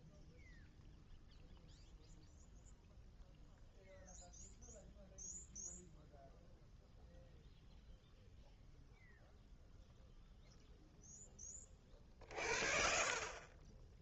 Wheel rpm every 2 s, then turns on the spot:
0, 0, 0, 0, 0, 0, 0.
none